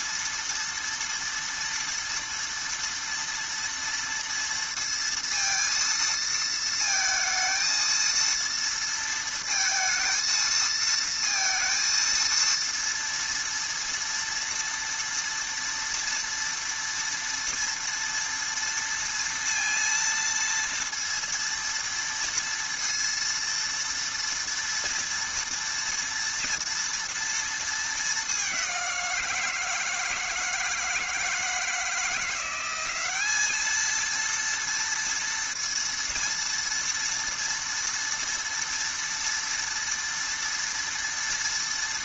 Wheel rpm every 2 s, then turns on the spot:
230, 230, 230, 220, 230, 230, 230, 230, 230, 230, 230, 230, 230, 230, 180, 160, 200, 230, 230, 230, 230.
none